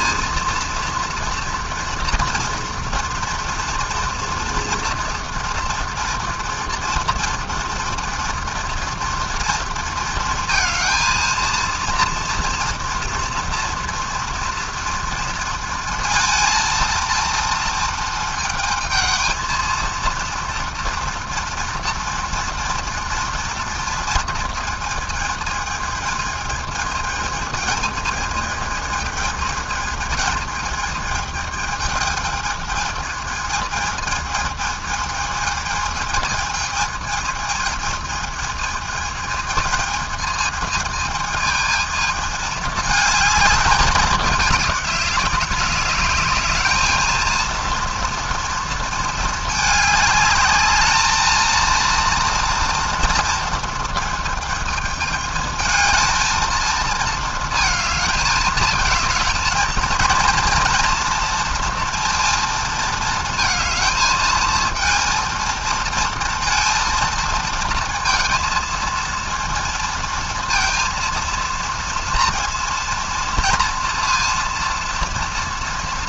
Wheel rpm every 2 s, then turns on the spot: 230, 230, 230, 230, 230, 220, 230, 230, 230, 220, 230, 230, 230, 220, 220, 220, 220, 220, 220, 220, 220, 220, 200, 210, 230, 210, 230, 220, 220, 220, 230, 230, 230, 230, 230, 230, 230, 230.
none